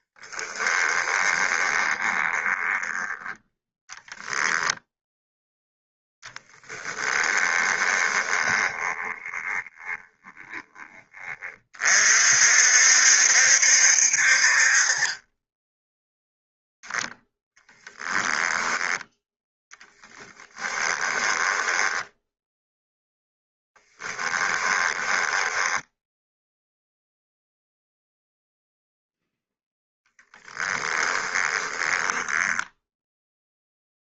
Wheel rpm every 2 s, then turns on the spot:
10, 10, 0, 10, 20, 20, 60, 30, 0, 10, 10, 10, 10, 0, 0, 20, 0.
0-4 6-10 20-22 24-26 30-32